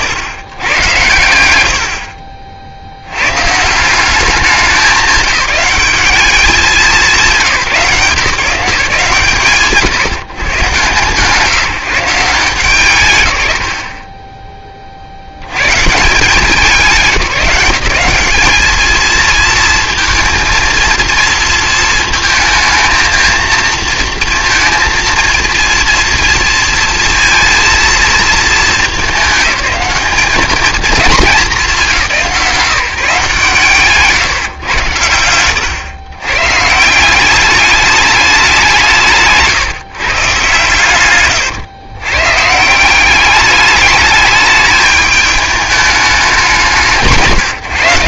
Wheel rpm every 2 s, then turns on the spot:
110, 60, 200, 200, 160, 130, 160, 30, 170, 220, 230, 220, 230, 230, 210, 210, 170, 120, 140, 180, 130, 160, 220, 180.
none